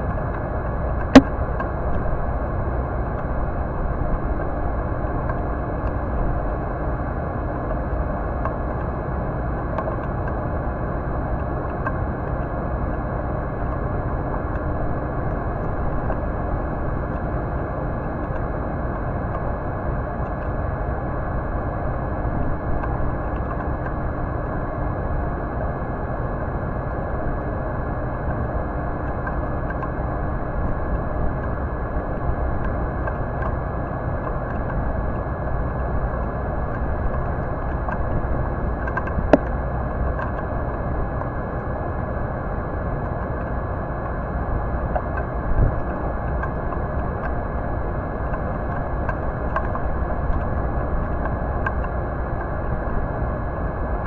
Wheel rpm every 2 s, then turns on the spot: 0, 0, 0, 0, 0, 0, 0, 0, 0, 0, 0, 0, 0, 0, 0, 0, 0, 0, 0, 0, 0, 0, 0, 0, 0, 0, 0.
none